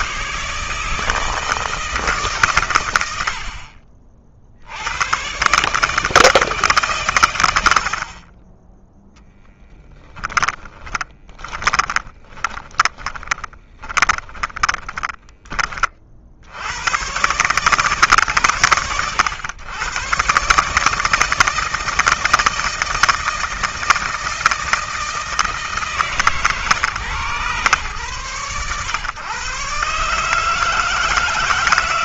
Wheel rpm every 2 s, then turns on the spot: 160, 90, 110, 130, 20, 20, 20, 30, 120, 120, 160, 160, 160, 130, 130, 160.
10-16